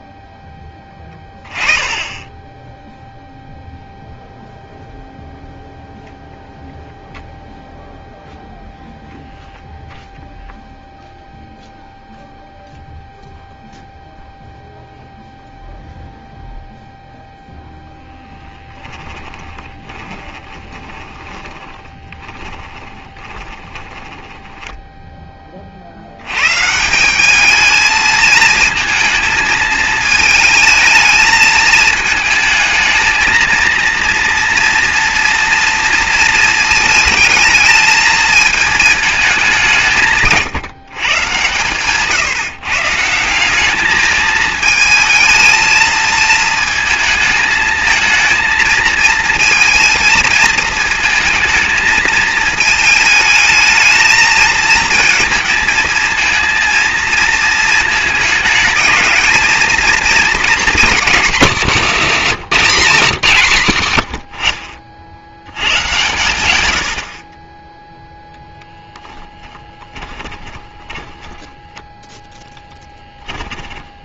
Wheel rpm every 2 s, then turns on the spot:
20, 0, 0, 0, 0, 0, 0, 0, 0, 20, 30, 20, 10, 180, 220, 220, 220, 230, 220, 210, 130, 150, 220, 220, 230, 220, 220, 230, 230, 220, 230, 190, 60, 80, 0, 10, 10.
18-24 62-64 70-74